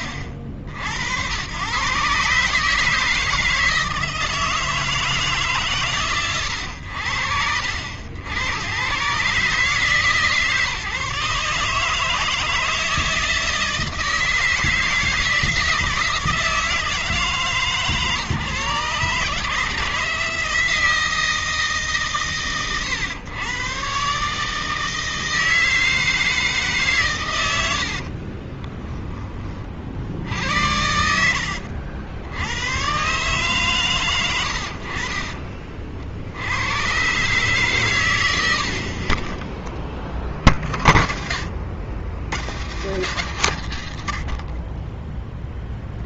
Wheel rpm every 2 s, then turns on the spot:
70, 150, 160, 110, 90, 150, 160, 160, 160, 130, 160, 120, 150, 150, 40, 60, 110, 70, 90, 90, 30, 130, 50.
28-30